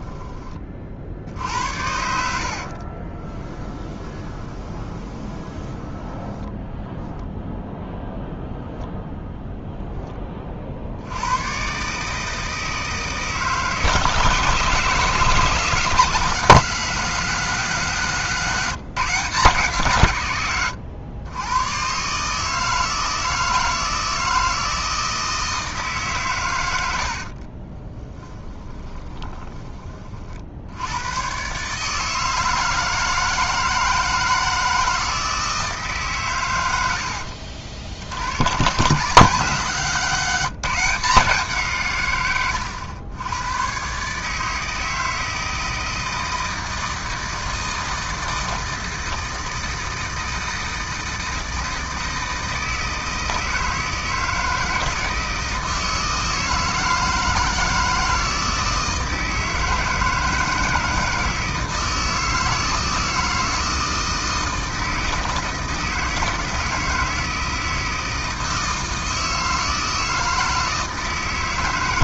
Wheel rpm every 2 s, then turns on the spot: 30, 60, 20, 10, 0, 30, 160, 150, 180, 160, 120, 150, 160, 100, 10, 60, 160, 160, 110, 110, 180, 110, 150, 160, 160, 160, 160, 160, 160, 160, 160, 160, 160, 160, 160, 160.
2-8 20-22 28-30 42-44